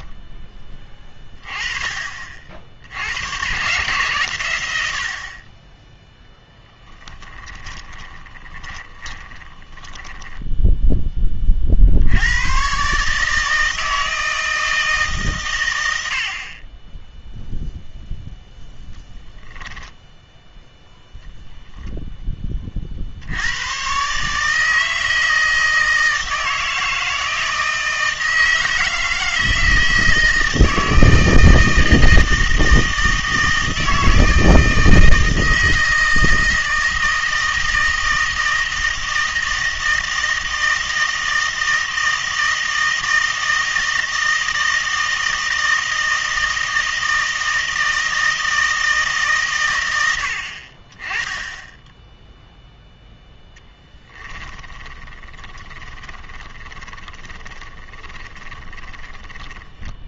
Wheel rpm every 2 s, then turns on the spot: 20, 70, 80, 10, 20, 0, 130, 160, 20, 0, 0, 40, 160, 160, 160, 160, 160, 160, 160, 160, 160, 160, 160, 160, 160, 30, 0, 20, 10, 10.
6-10 54-60